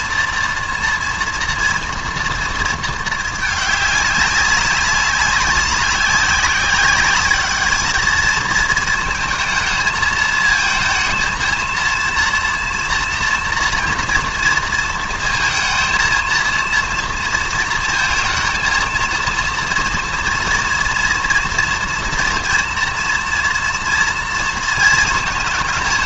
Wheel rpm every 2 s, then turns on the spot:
230, 230, 200, 190, 220, 220, 230, 230, 230, 230, 230, 230, 230.
none